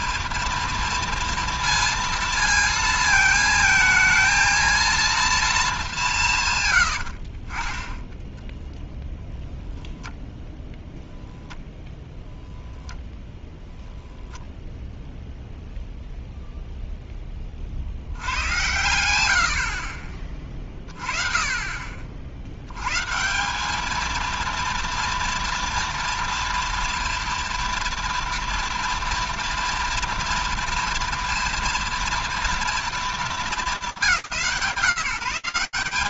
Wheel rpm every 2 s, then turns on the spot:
230, 220, 230, 40, 0, 0, 10, 0, 0, 90, 30, 150, 230, 230, 230, 230, 220, 140.
none